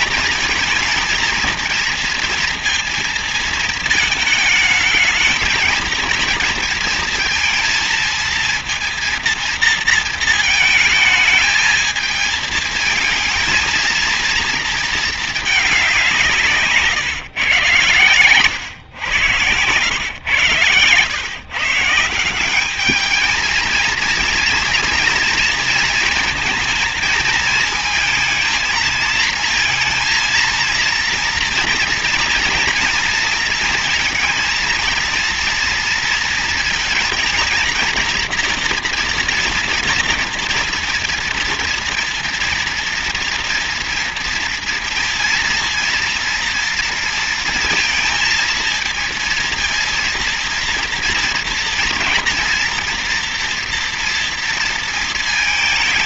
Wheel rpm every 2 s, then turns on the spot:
230, 230, 230, 230, 230, 220, 220, 230, 160, 120, 120, 180, 230, 230, 220, 230, 230, 230, 230, 230, 240, 230, 230, 230, 230, 230, 230, 230.
none